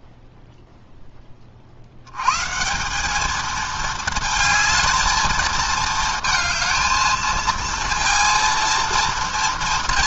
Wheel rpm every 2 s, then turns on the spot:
0, 160, 220, 220, 230.
none